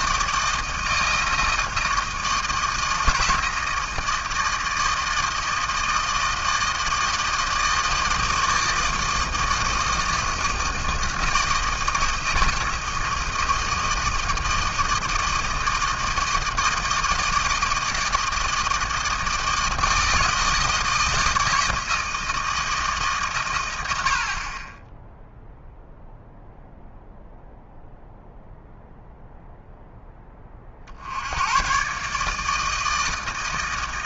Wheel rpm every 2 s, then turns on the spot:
160, 160, 160, 160, 160, 160, 160, 160, 160, 160, 160, 160, 40, 0, 0, 30, 160.
none